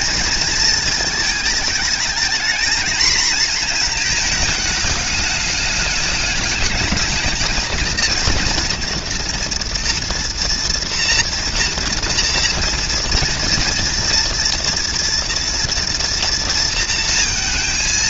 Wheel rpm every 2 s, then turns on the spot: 230, 230, 220, 210, 230, 230, 230, 230, 230.
none